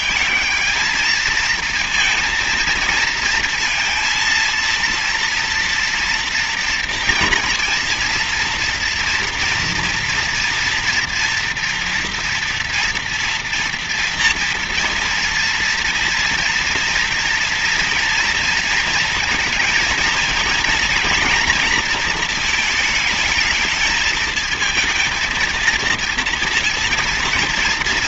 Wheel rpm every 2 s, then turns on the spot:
220, 230, 230, 230, 230, 230, 230, 230, 230, 230, 220, 220, 220, 230.
none